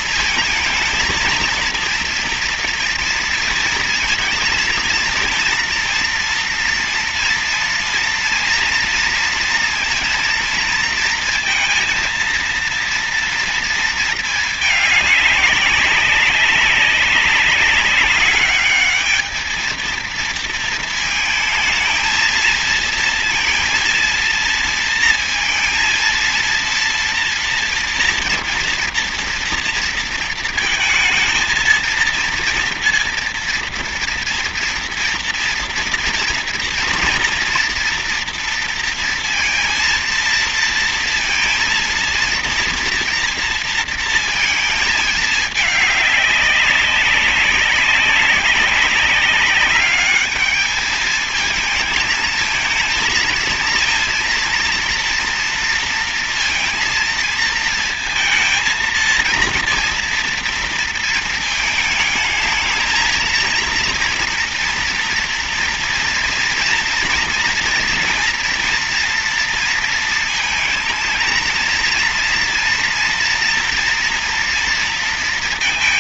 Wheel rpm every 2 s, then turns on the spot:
220, 230, 230, 230, 230, 230, 230, 220, 190, 200, 230, 230, 230, 230, 230, 230, 230, 230, 230, 230, 230, 230, 220, 200, 200, 210, 220, 240, 230, 220, 230, 220, 230, 230, 240, 230, 230, 230.
none